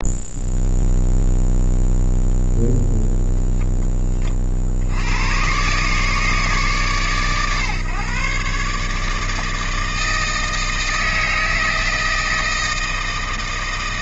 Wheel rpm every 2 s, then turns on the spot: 0, 0, 50, 150, 140, 160, 160.
none